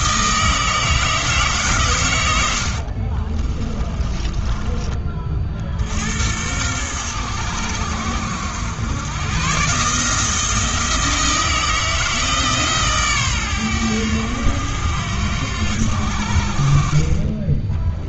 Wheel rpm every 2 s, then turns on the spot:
160, 60, 30, 100, 100, 160, 140, 90, 40.
2-4